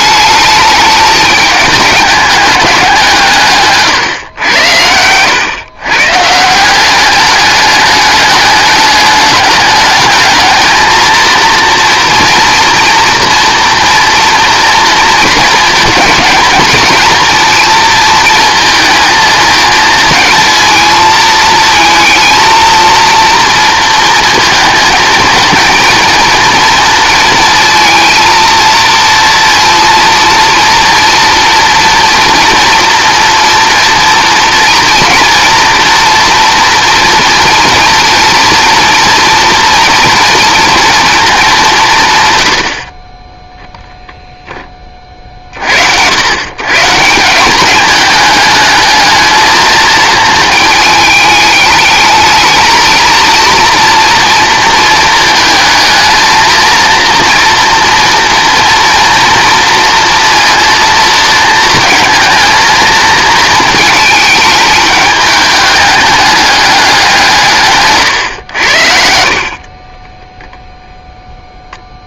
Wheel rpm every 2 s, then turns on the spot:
210, 200, 100, 180, 210, 230, 240, 230, 230, 230, 220, 230, 220, 230, 230, 230, 230, 230, 230, 230, 240, 80, 20, 130, 220, 220, 220, 230, 230, 230, 230, 230, 210, 200, 80, 0.
none